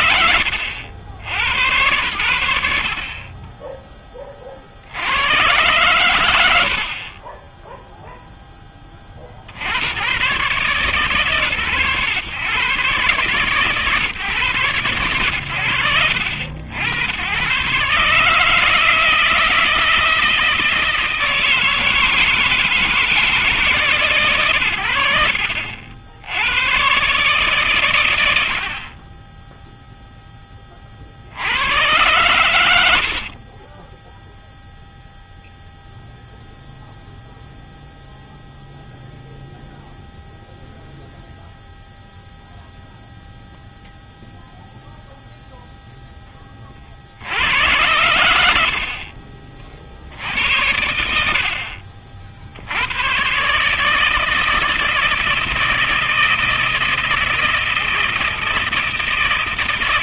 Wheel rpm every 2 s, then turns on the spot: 90, 80, 10, 100, 10, 120, 130, 130, 70, 150, 160, 160, 100, 90, 60, 20, 100, 0, 0, 0, 0, 0, 0, 20, 90, 90, 80, 160, 160, 160.
0-2 32-34